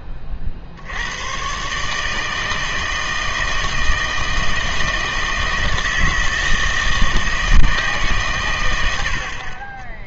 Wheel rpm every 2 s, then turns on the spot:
50, 160, 160, 160, 110.
none